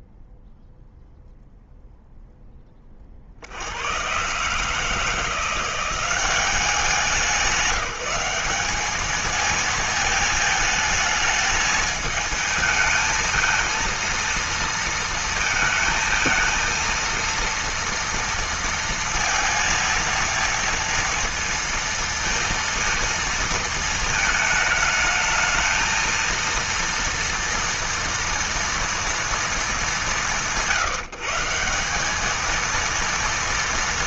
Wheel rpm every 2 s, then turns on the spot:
0, 20, 150, 190, 200, 220, 220, 230, 230, 230, 230, 230, 220, 230, 230, 150, 230.
none